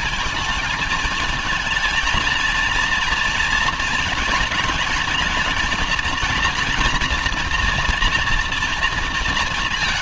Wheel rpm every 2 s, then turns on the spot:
220, 230, 230, 240, 230.
none